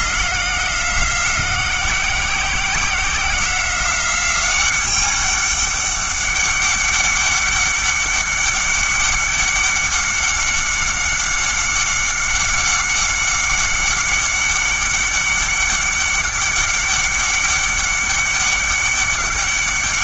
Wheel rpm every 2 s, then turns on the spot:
180, 180, 200, 200, 200, 200, 190, 200, 200, 200.
none